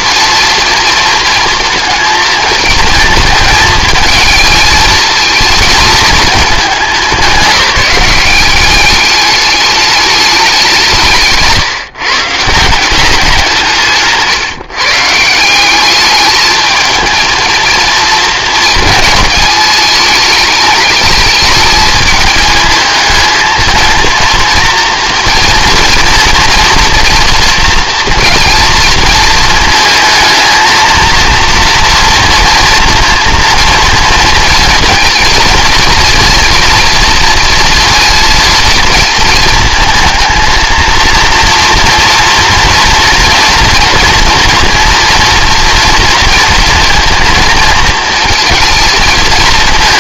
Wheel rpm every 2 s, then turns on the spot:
230, 220, 220, 200, 200, 170, 180, 150, 220, 230, 210, 220, 230, 230, 230, 230, 230, 230, 230, 230, 230, 240, 230, 230, 220.
none